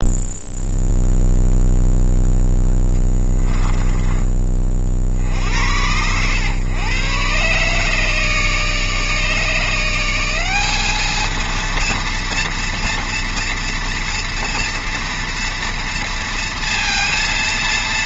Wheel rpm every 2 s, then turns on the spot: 0, 10, 30, 110, 150, 200, 230, 230, 230.
2-4